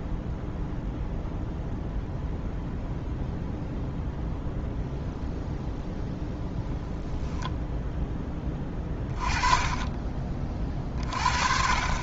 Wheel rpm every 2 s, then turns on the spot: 0, 0, 0, 0, 20, 40.
none